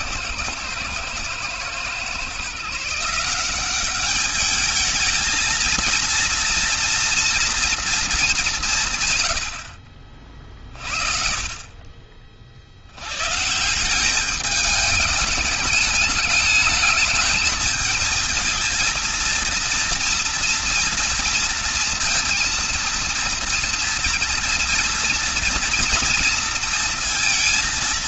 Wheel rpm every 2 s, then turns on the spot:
110, 160, 220, 230, 150, 50, 70, 210, 210, 230, 230, 230, 230, 230.
none